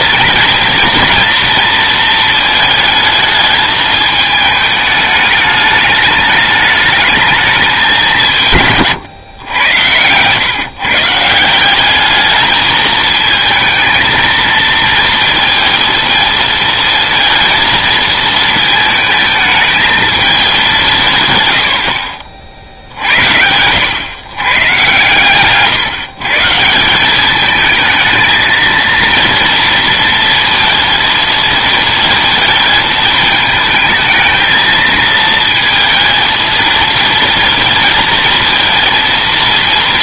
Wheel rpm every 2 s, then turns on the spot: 230, 220, 210, 210, 140, 130, 220, 230, 220, 220, 190, 60, 130, 170, 230, 230, 220, 220, 230, 230.
none